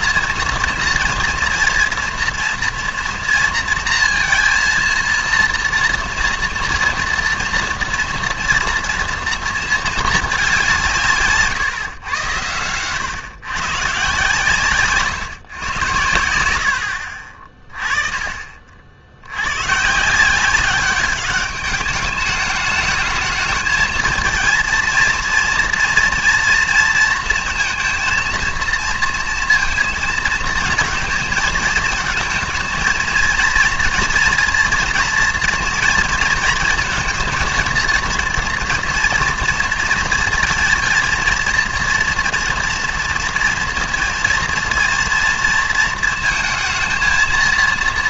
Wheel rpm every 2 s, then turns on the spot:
230, 230, 230, 230, 240, 190, 110, 140, 70, 40, 190, 210, 230, 230, 230, 230, 230, 230, 230, 230, 220, 230, 230, 220.
none